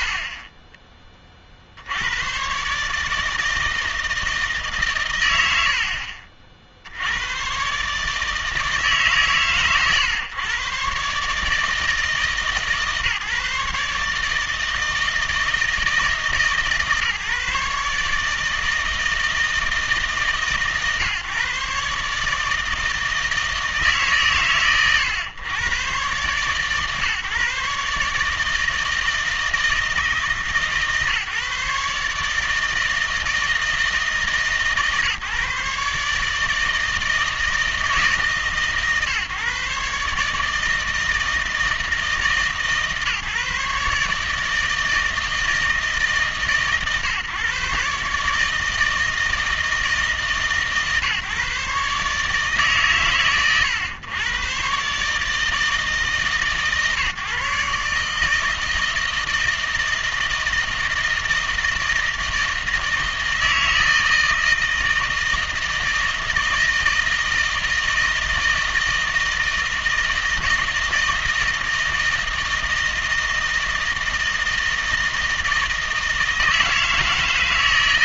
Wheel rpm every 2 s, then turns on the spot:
40, 140, 140, 60, 150, 130, 150, 160, 150, 160, 140, 160, 110, 130, 160, 150, 160, 140, 160, 140, 160, 150, 160, 140, 160, 140, 140, 130, 140, 160, 160, 160, 160, 160, 160, 160, 160, 160, 160.
0-2